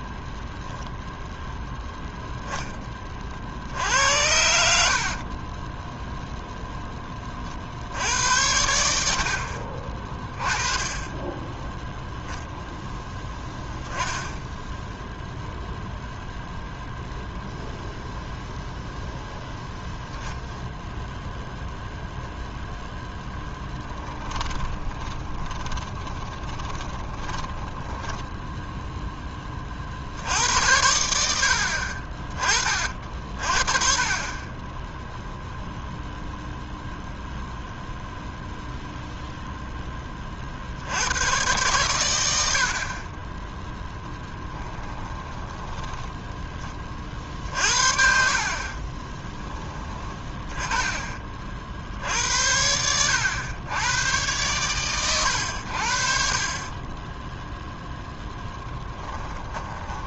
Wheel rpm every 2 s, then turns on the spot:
0, 30, 70, 10, 80, 20, 0, 0, 0, 0, 0, 0, 20, 10, 0, 80, 20, 20, 0, 0, 70, 50, 10, 30, 30, 10, 80, 120, 30, 20.
4-6 24-28 44-46 48-50 58-60